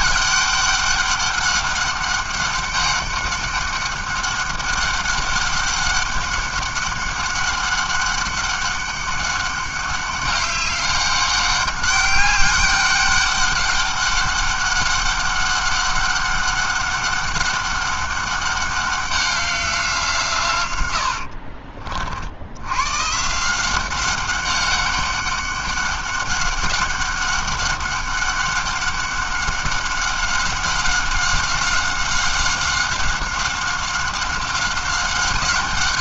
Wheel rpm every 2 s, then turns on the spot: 200, 200, 200, 200, 200, 200, 200, 200, 200, 200, 130, 90, 190, 200, 200, 190, 190, 190.
none